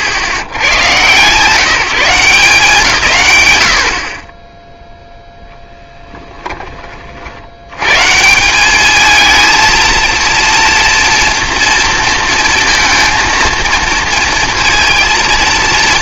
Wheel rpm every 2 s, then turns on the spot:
120, 160, 10, 30, 200, 230, 230, 230.
none